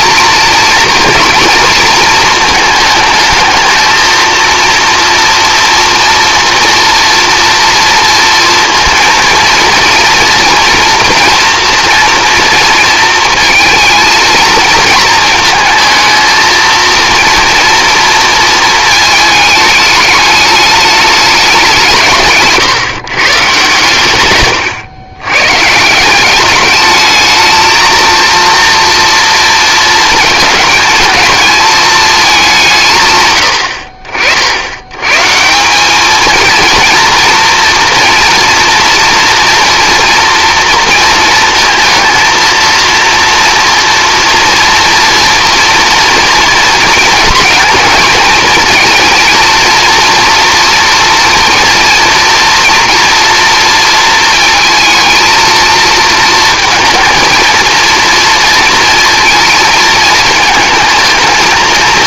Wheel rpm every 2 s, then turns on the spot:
230, 220, 230, 230, 230, 230, 230, 220, 230, 220, 210, 140, 110, 210, 230, 220, 160, 100, 230, 230, 230, 230, 230, 230, 220, 230, 240, 230, 230, 230, 220.
none